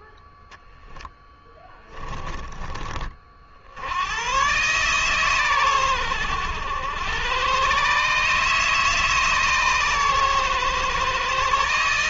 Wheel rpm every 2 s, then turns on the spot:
10, 50, 130, 100, 150, 130.
0-2